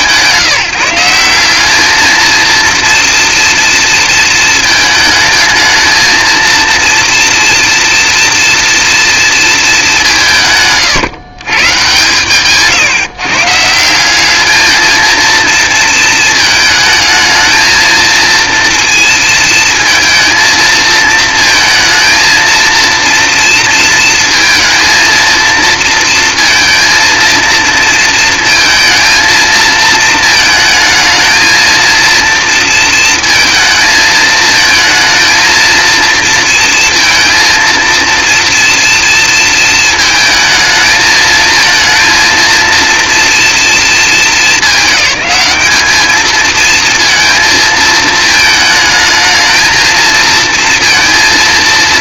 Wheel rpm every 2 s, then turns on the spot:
180, 230, 220, 230, 230, 150, 140, 220, 220, 230, 220, 230, 230, 230, 230, 220, 230, 220, 230, 230, 220, 230, 210, 220, 220, 230.
10-12